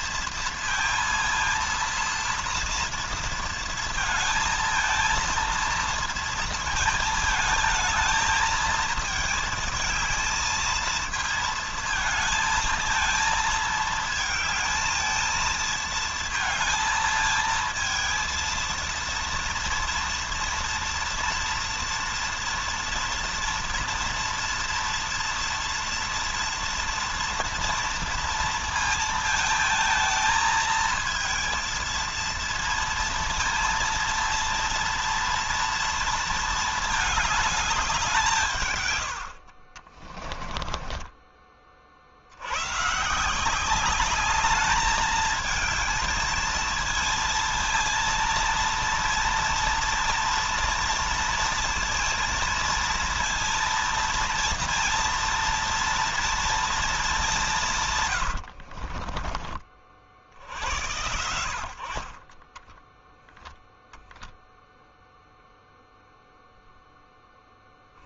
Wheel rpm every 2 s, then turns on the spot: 230, 230, 230, 220, 220, 220, 220, 220, 230, 230, 230, 230, 230, 230, 220, 230, 230, 230, 220, 110, 20, 140, 210, 230, 230, 230, 230, 230, 210, 40, 80, 10, 0, 0.
40-42 58-60 62-64